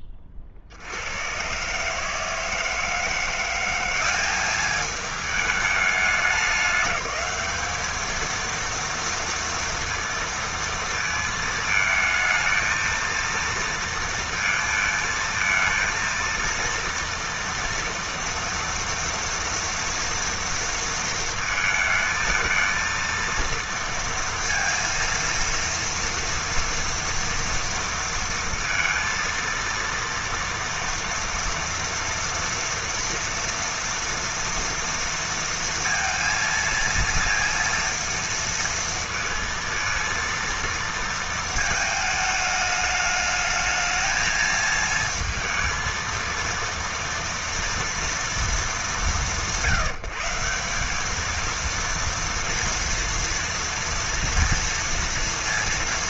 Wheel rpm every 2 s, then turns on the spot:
60, 170, 210, 210, 230, 220, 230, 220, 230, 230, 230, 230, 230, 230, 230, 230, 230, 230, 230, 230, 230, 210, 220, 230, 180, 200, 230, 230.
none